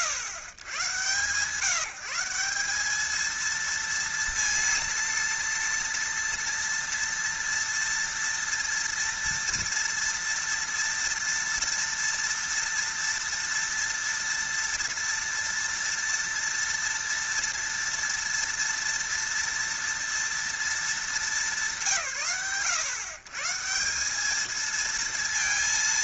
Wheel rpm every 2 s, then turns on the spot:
110, 200, 230, 240, 230, 230, 230, 230, 240, 230, 230, 130, 230.
none